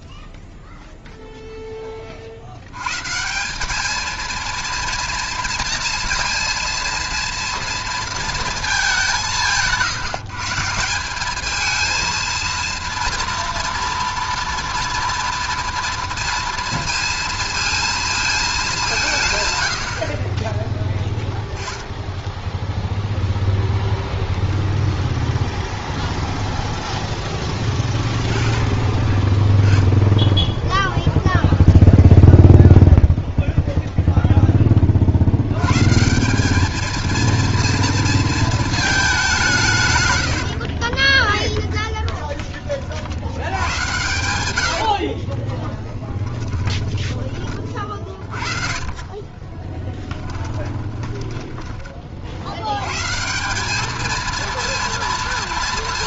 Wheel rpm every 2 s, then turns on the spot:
70, 230, 230, 230, 150, 230, 240, 230, 220, 30, 10, 0, 0, 20, 10, 0, 0, 100, 230, 150, 10, 90, 20, 30, 10, 20, 180, 230.
40-46 48-52